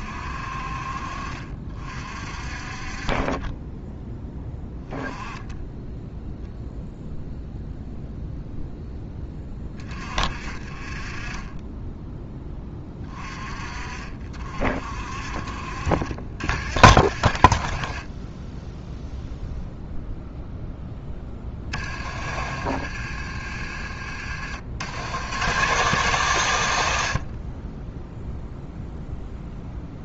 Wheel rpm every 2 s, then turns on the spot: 50, 40, 10, 0, 0, 30, 20, 50, 60, 10, 10, 50, 90, 110, 0.
none